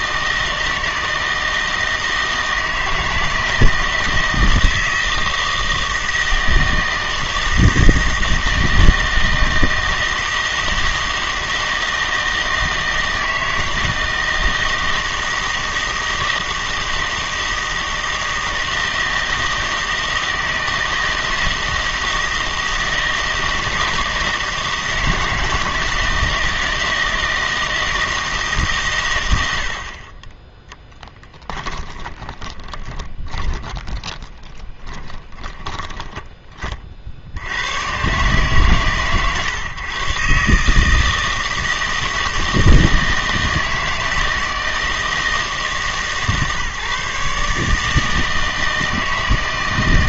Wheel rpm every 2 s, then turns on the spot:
160, 160, 160, 160, 160, 160, 160, 160, 160, 160, 160, 160, 160, 160, 150, 10, 10, 10, 30, 120, 140, 160, 160, 150, 160.
32-36